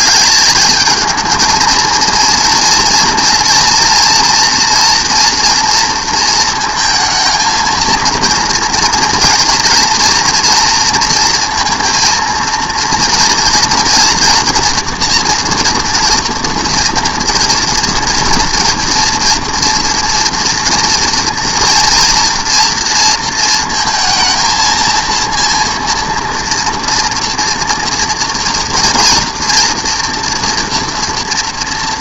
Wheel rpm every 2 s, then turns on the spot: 210, 230, 230, 230, 230, 240, 230, 240, 230, 230, 230, 230, 220, 230, 230, 230.
none